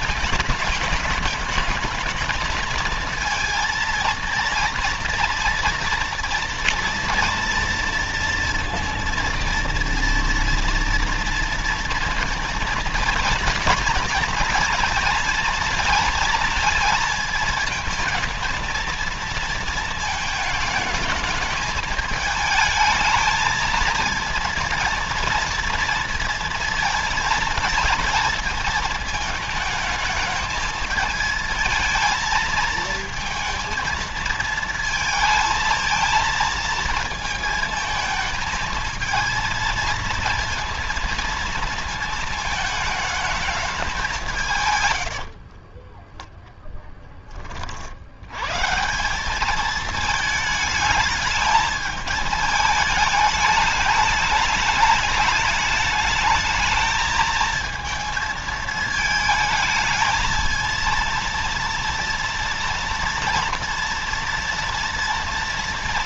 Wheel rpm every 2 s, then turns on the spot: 220, 220, 230, 230, 230, 230, 230, 230, 220, 220, 220, 220, 230, 230, 220, 220, 230, 230, 230, 220, 230, 220, 140, 0, 130, 220, 220, 210, 220, 220, 230, 230, 230.
44-46